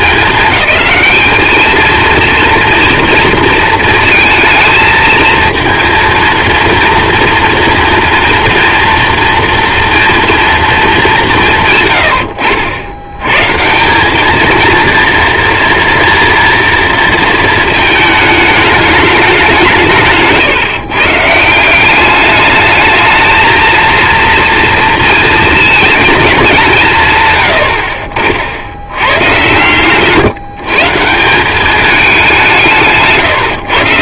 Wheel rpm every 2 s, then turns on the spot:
210, 230, 220, 230, 230, 190, 80, 230, 230, 200, 140, 210, 230, 150, 80, 150, 160.
none